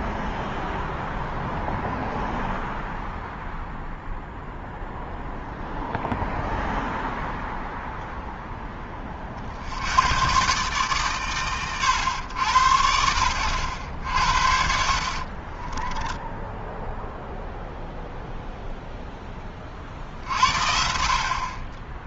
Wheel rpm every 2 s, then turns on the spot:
0, 0, 0, 0, 10, 120, 90, 60, 10, 0, 60.
16-18